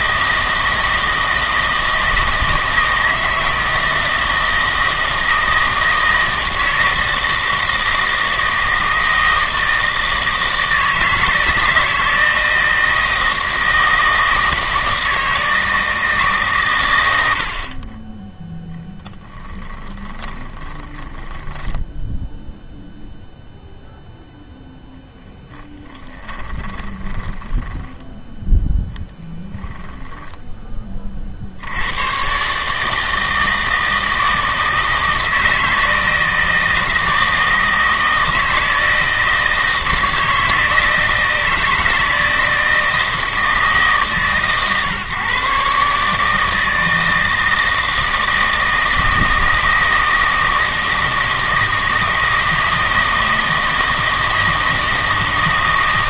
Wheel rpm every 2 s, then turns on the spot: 160, 160, 160, 160, 160, 160, 160, 160, 120, 10, 20, 0, 10, 10, 0, 20, 150, 160, 160, 160, 160, 160, 130, 160, 160, 160, 160, 160.
18-22 24-28